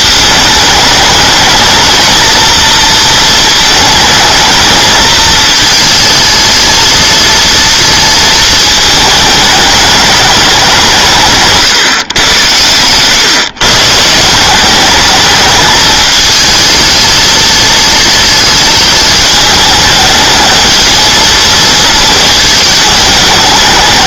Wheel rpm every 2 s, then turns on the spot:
210, 230, 220, 230, 220, 180, 110, 190, 220, 220, 220, 220.
none